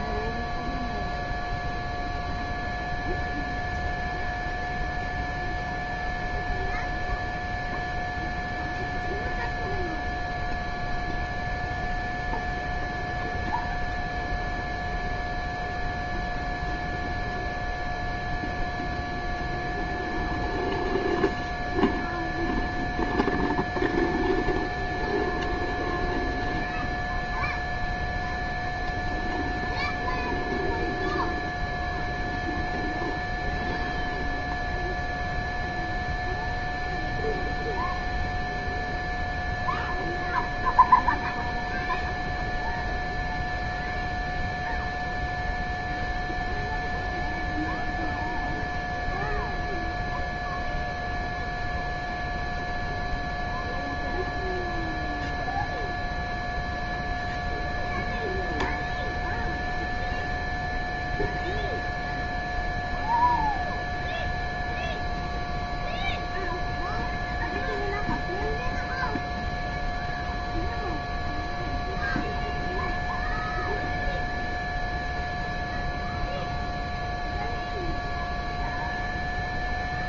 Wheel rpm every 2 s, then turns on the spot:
0, 0, 0, 0, 0, 0, 0, 0, 0, 0, 0, 0, 0, 0, 0, 0, 0, 0, 0, 0, 0, 0, 0, 0, 0, 0, 0, 0, 0, 0, 0, 0, 0, 0, 0, 0, 0, 0, 0, 0.
none